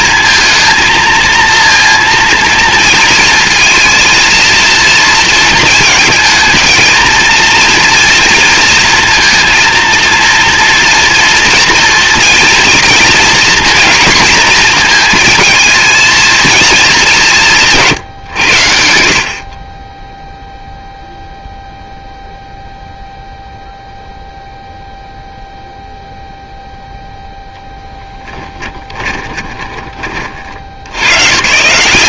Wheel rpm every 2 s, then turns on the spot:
230, 230, 230, 230, 230, 230, 230, 230, 180, 40, 0, 0, 0, 0, 20, 90.
28-30